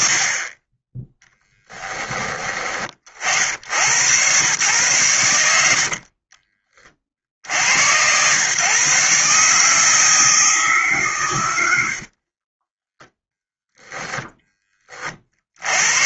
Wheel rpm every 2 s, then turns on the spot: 10, 50, 120, 30, 140, 120, 0, 40.
none